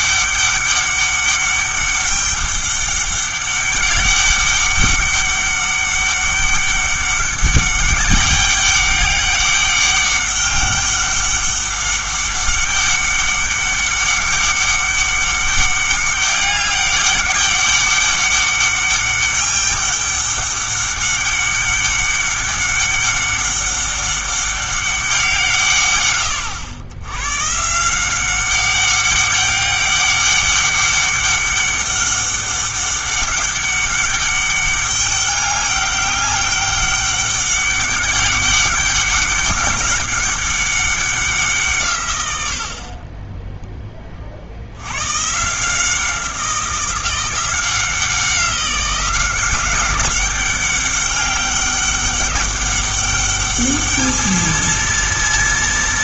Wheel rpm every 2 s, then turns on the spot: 200, 200, 200, 200, 200, 200, 200, 200, 200, 200, 200, 200, 200, 100, 200, 200, 200, 200, 200, 200, 200, 60, 80, 180, 180, 200, 200, 230.
none